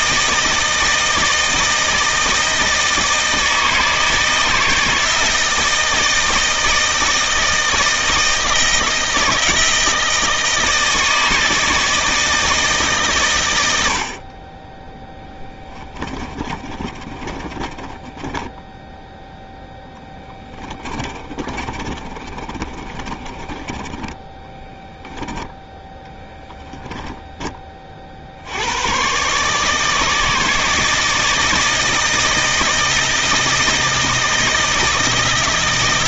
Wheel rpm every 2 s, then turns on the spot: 160, 160, 160, 160, 160, 160, 150, 10, 30, 0, 20, 20, 10, 10, 100, 160, 160, 160.
16-18 20-26